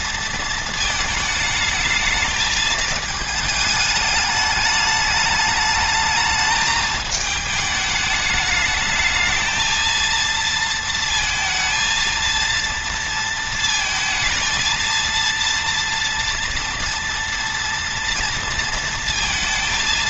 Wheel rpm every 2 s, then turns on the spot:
220, 220, 210, 220, 220, 230, 230, 230, 230, 230.
none